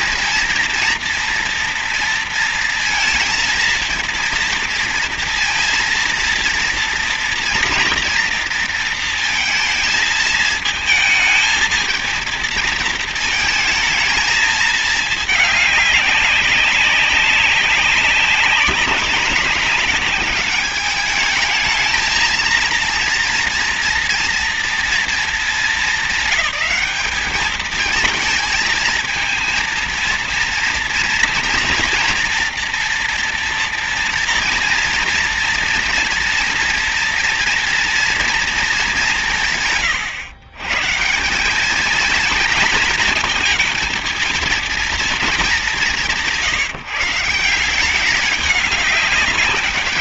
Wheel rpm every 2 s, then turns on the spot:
230, 230, 230, 230, 230, 220, 220, 220, 200, 200, 210, 230, 230, 210, 230, 240, 230, 230, 230, 200, 160, 230, 220, 160, 200.
none